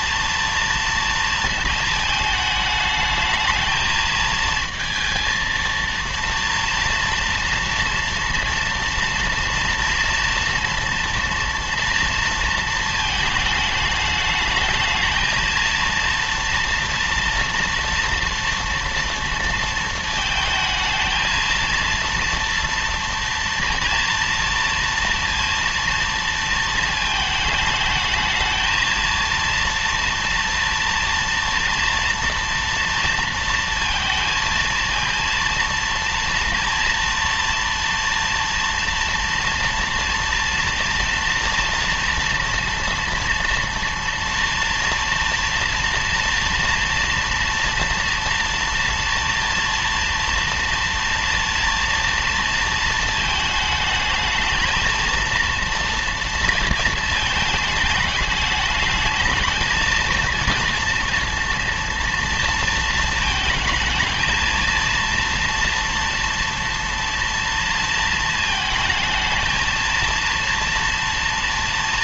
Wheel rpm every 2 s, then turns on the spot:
230, 220, 230, 230, 230, 240, 230, 210, 230, 230, 220, 230, 230, 230, 220, 230, 230, 230, 230, 230, 230, 230, 230, 230, 230, 230, 230, 220, 230, 210, 230, 230, 230, 230, 220, 230.
none